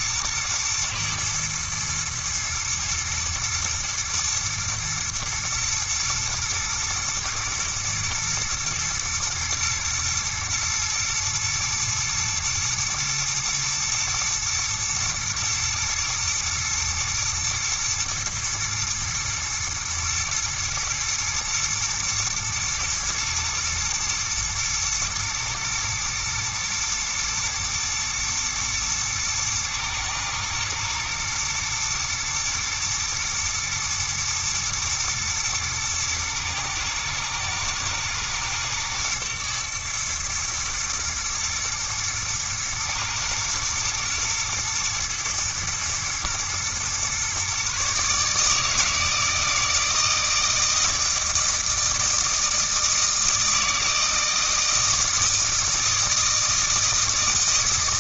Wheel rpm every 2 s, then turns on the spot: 120, 120, 110, 110, 120, 120, 120, 120, 110, 120, 110, 120, 110, 110, 120, 120, 110, 110, 110, 110, 110, 120, 110, 120, 160, 160, 160, 160, 160.
none